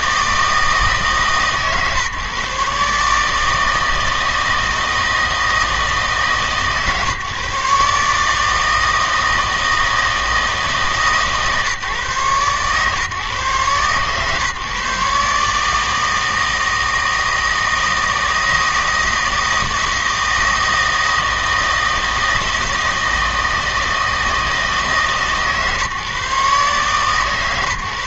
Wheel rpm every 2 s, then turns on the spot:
150, 140, 160, 150, 160, 150, 130, 140, 160, 160, 160, 160, 160, 140.
none